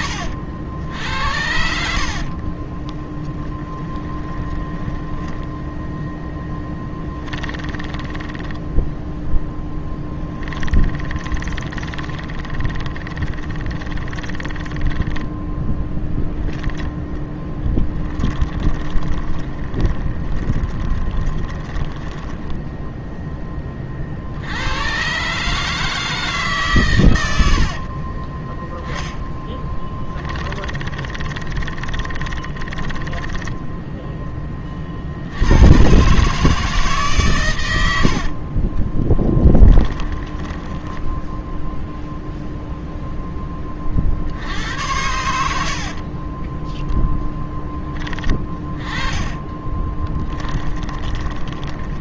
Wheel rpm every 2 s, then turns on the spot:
80, 20, 10, 10, 10, 20, 20, 20, 10, 20, 20, 10, 110, 140, 10, 20, 10, 50, 150, 30, 10, 0, 80, 10, 30, 20.
0-16 18-22 30-34 38-42 46-52